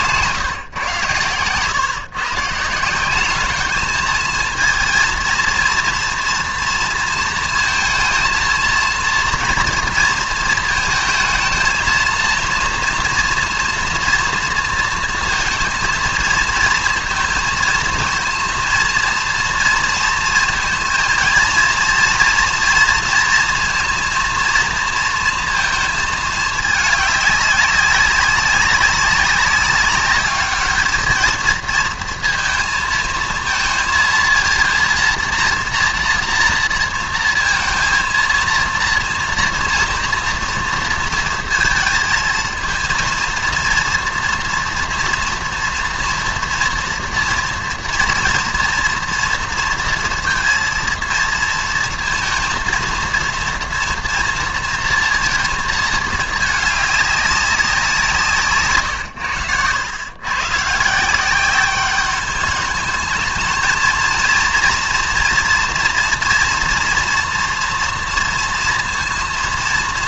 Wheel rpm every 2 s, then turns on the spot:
130, 150, 220, 230, 230, 220, 230, 230, 220, 230, 230, 230, 230, 220, 200, 210, 230, 230, 230, 230, 230, 220, 230, 230, 230, 230, 230, 230, 210, 140, 130, 210, 230, 230, 230.
none